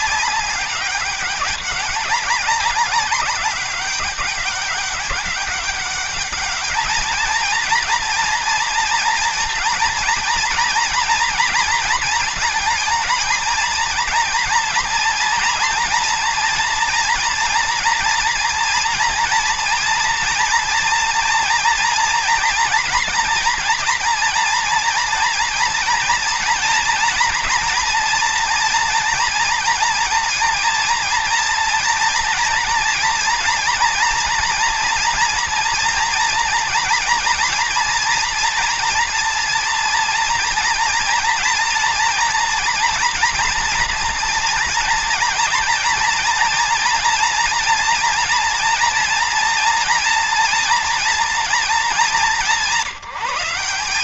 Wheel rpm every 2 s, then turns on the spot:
200, 200, 200, 220, 220, 230, 230, 240, 230, 230, 230, 230, 230, 240, 240, 230, 230, 240, 230, 230, 230, 240, 230, 230, 230, 230, 190.
none